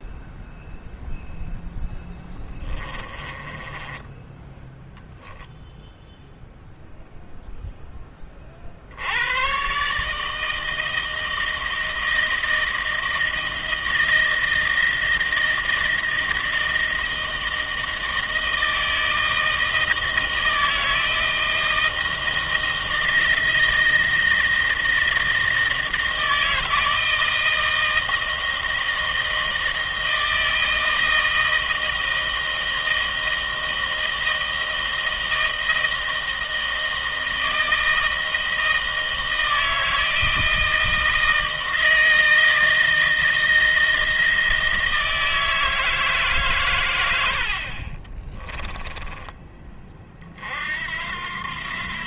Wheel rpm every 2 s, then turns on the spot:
0, 20, 10, 0, 40, 160, 160, 160, 160, 160, 160, 160, 160, 160, 160, 160, 160, 160, 160, 160, 160, 160, 160, 120, 20, 60.
2-4 48-50